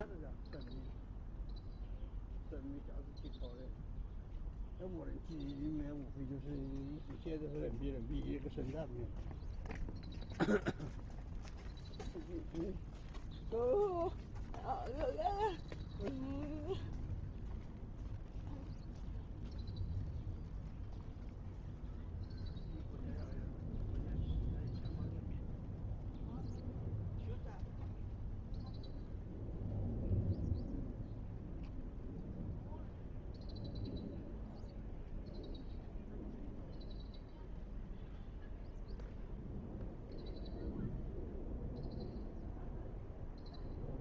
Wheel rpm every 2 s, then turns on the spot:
0, 0, 0, 0, 0, 0, 0, 0, 0, 0, 0, 0, 0, 0, 0, 0, 0, 0, 0, 0, 0, 0.
none